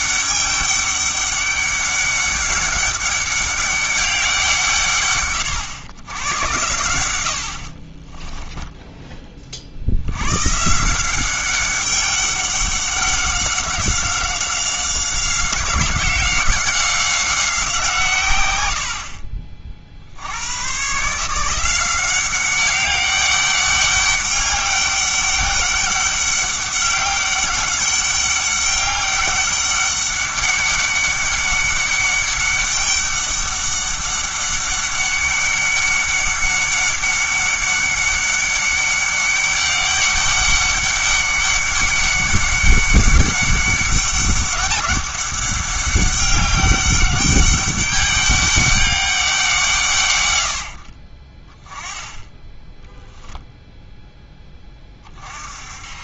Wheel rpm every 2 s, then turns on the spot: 200, 200, 160, 80, 20, 150, 190, 190, 190, 80, 120, 200, 200, 200, 200, 200, 200, 200, 200, 200, 200, 200, 200, 200, 200, 80, 10, 20.
8-10